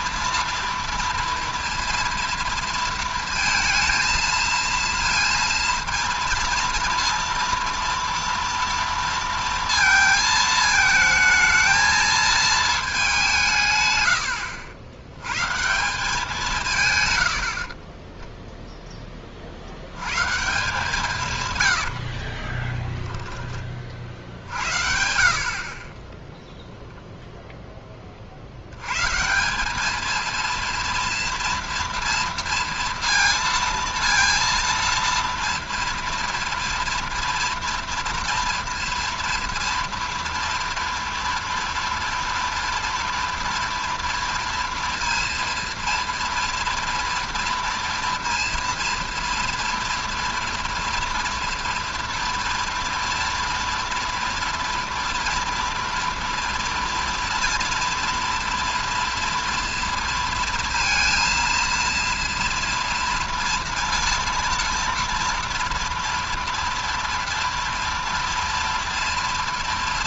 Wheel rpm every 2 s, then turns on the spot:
230, 230, 230, 230, 230, 220, 220, 80, 150, 0, 160, 20, 70, 0, 80, 230, 230, 230, 230, 230, 230, 230, 230, 230, 230, 230, 230, 240, 230, 240, 230, 230, 230, 240, 240.
22-24